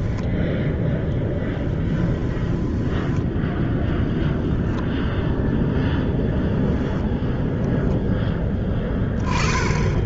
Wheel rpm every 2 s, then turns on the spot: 10, 10, 0, 0, 10.
2-4